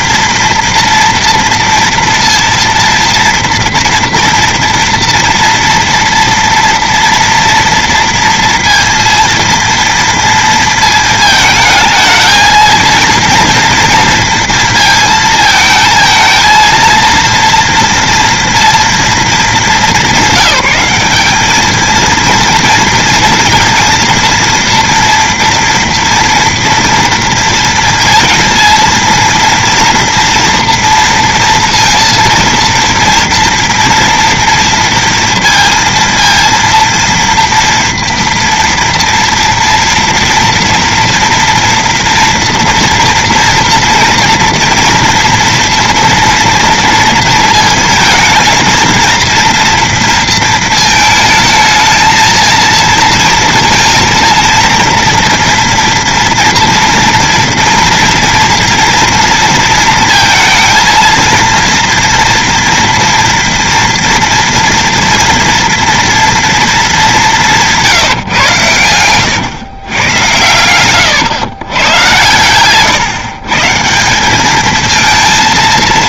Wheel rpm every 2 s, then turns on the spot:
230, 230, 230, 230, 230, 230, 230, 220, 230, 230, 200, 230, 240, 230, 230, 230, 230, 230, 230, 240, 230, 230, 230, 230, 230, 220, 230, 230, 230, 230, 230, 230, 230, 220, 110, 100, 130, 220.
70-72